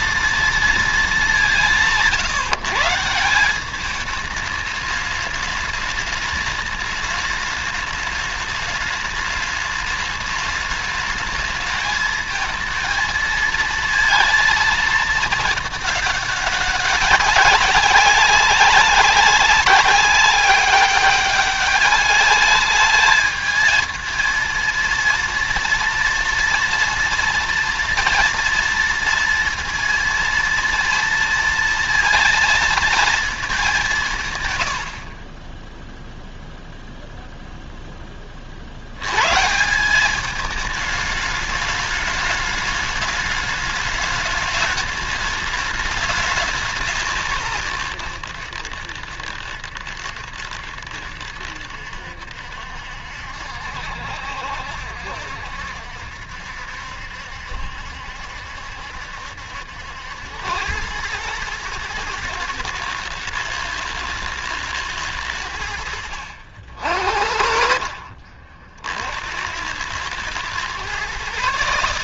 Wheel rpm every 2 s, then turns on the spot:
230, 150, 210, 210, 210, 210, 220, 220, 200, 190, 200, 210, 230, 230, 230, 230, 230, 110, 0, 50, 210, 210, 210, 190, 90, 70, 70, 70, 70, 70, 100, 110, 110, 60, 50, 120.
none